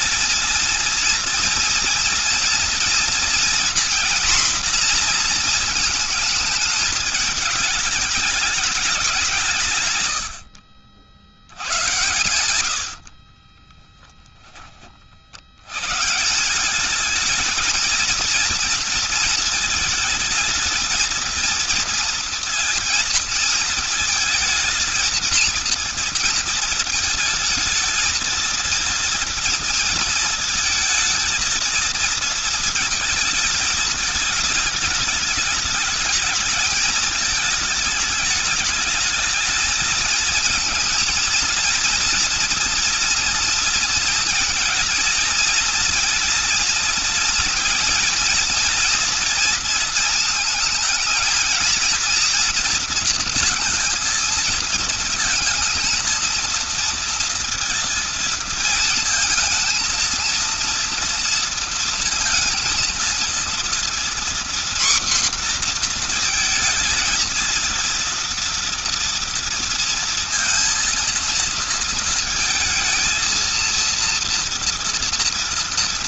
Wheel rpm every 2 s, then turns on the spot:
230, 230, 240, 220, 210, 70, 80, 10, 180, 230, 220, 230, 230, 230, 220, 220, 230, 220, 220, 220, 220, 230, 230, 230, 240, 220, 230, 230, 230, 220, 230, 230, 240, 230, 230, 230, 230, 230.
none